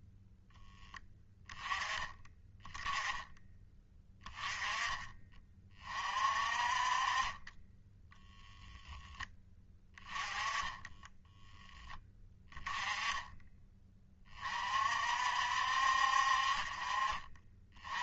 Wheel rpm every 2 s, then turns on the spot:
10, 30, 20, 30, 10, 10, 10, 50, 40.
10-12